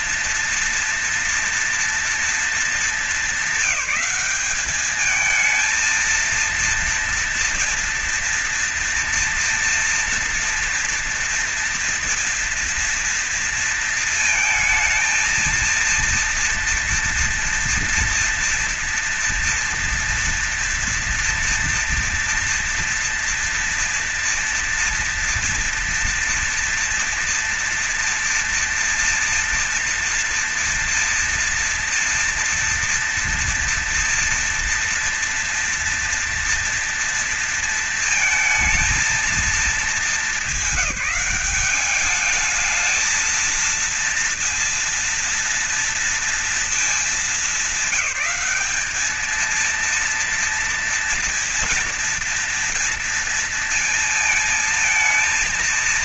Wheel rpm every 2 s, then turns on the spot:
230, 210, 200, 230, 230, 230, 230, 230, 230, 230, 230, 230, 230, 230, 230, 230, 230, 230, 240, 230, 210, 210, 230, 230, 210, 230, 230, 230.
none